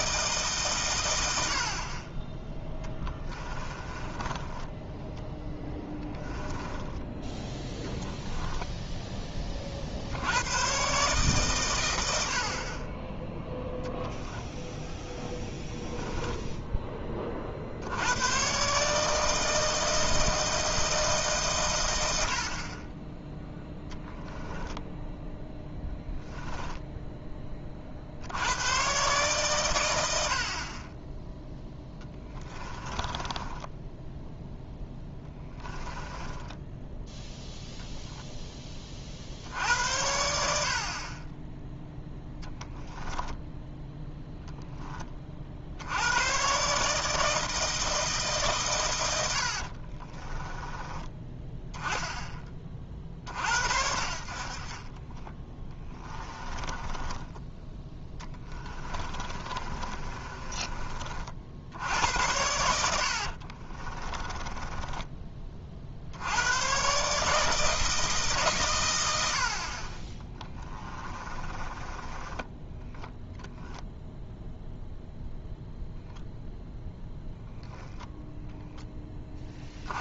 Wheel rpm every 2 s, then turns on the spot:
130, 10, 10, 10, 10, 130, 30, 0, 20, 150, 160, 30, 10, 10, 120, 30, 20, 10, 10, 30, 50, 10, 20, 150, 110, 20, 40, 30, 20, 30, 40, 70, 20, 130, 110, 30, 0, 0, 0, 10.
2-6 24-28 32-36 42-44 48-50 56-60 62-66 70-72